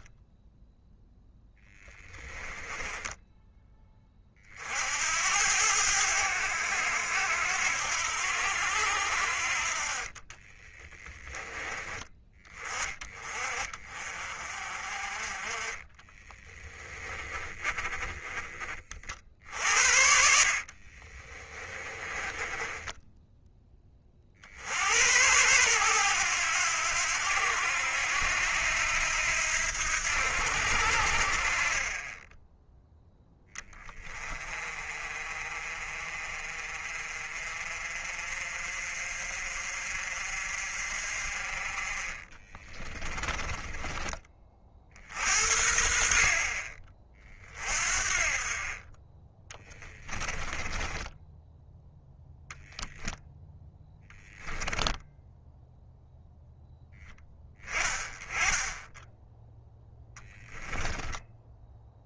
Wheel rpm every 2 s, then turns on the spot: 0, 10, 70, 80, 70, 20, 30, 40, 10, 40, 40, 10, 80, 90, 80, 70, 0, 40, 40, 50, 50, 20, 50, 30, 30, 20, 0, 10, 10, 10, 10.
2-4 10-12 16-18 20-24 42-44 50-52 54-56